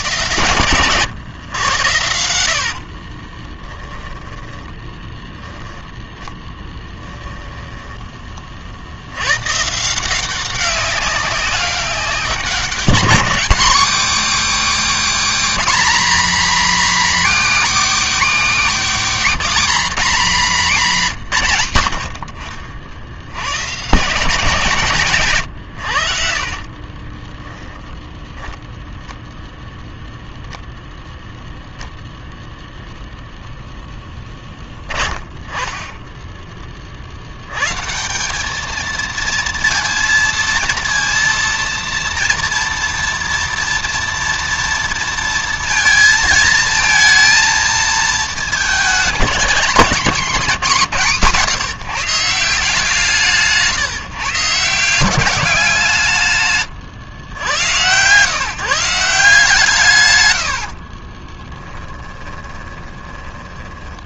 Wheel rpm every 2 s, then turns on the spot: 120, 60, 10, 10, 50, 190, 200, 260, 260, 250, 210, 60, 160, 40, 0, 0, 0, 20, 30, 220, 230, 230, 230, 220, 220, 210, 150, 160, 140, 150, 90, 20.
2-4 6-8 26-28 60-64